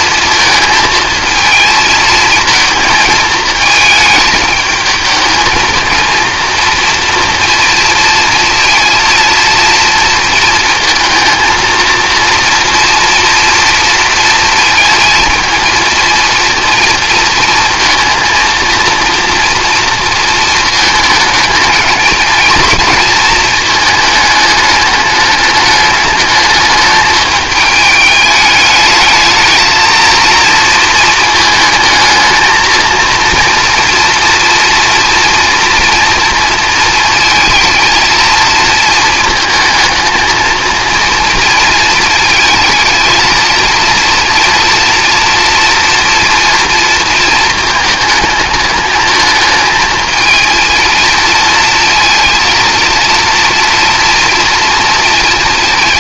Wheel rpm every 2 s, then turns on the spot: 220, 220, 220, 230, 230, 230, 230, 230, 230, 230, 230, 230, 210, 210, 210, 230, 220, 230, 230, 220, 230, 220, 240, 230, 220, 230, 230, 230.
none